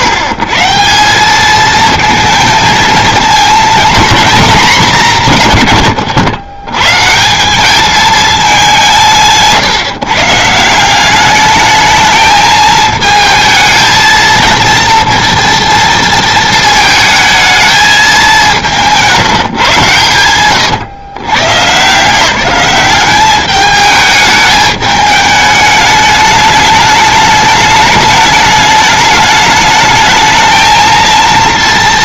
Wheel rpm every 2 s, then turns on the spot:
130, 230, 230, 120, 190, 160, 220, 230, 220, 180, 130, 190, 210, 210, 210, 220.
20-22